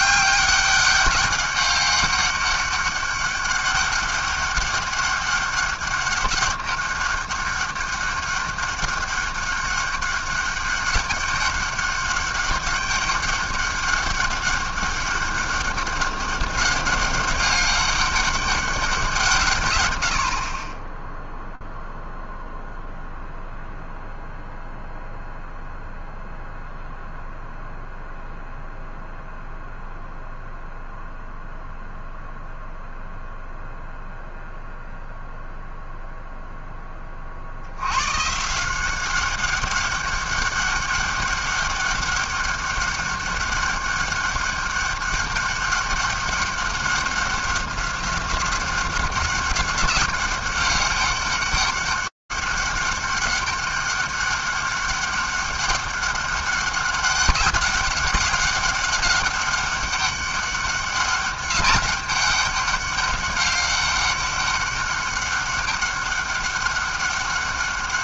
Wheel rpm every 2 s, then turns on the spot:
200, 200, 200, 200, 200, 200, 200, 200, 200, 200, 60, 0, 0, 0, 0, 0, 0, 0, 0, 150, 200, 200, 200, 200, 190, 190, 200, 200, 200, 200, 200, 200, 200, 200.
none